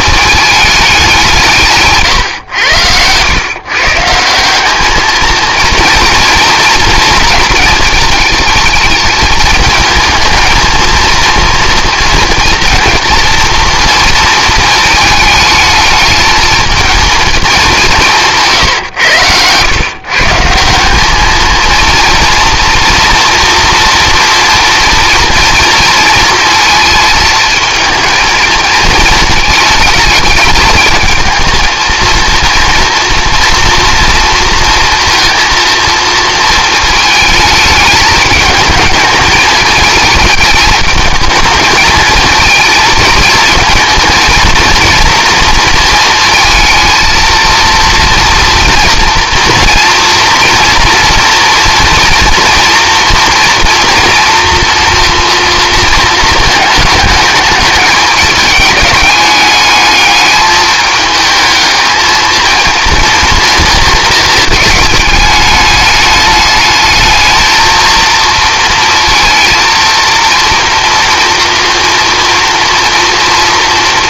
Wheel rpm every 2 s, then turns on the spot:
200, 100, 210, 230, 220, 230, 240, 220, 220, 120, 180, 230, 230, 230, 220, 220, 230, 230, 220, 220, 220, 230, 230, 230, 230, 230, 230, 230, 220, 210, 210, 230, 210, 220, 230, 230, 230.
none